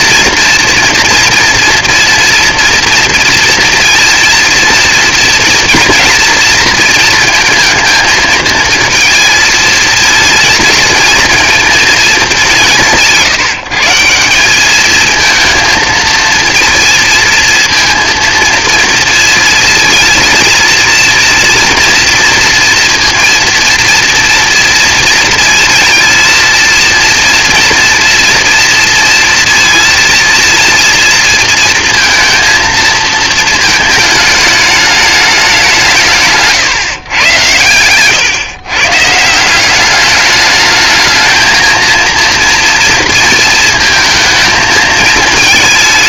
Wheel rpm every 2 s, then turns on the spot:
240, 230, 230, 230, 230, 230, 180, 200, 230, 230, 230, 230, 230, 230, 230, 230, 220, 210, 140, 130, 210, 230, 220.
none